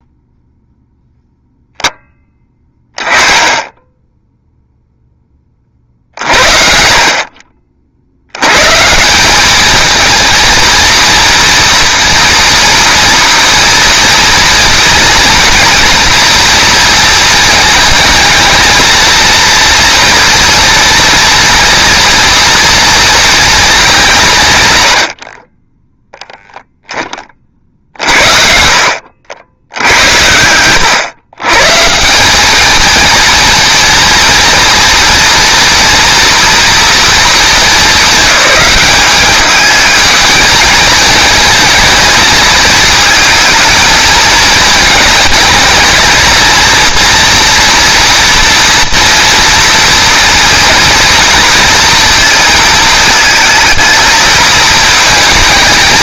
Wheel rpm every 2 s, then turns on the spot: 0, 20, 0, 60, 130, 230, 240, 230, 230, 220, 230, 230, 120, 0, 60, 100, 220, 230, 230, 210, 220, 220, 220, 230, 230, 230, 220, 220.
none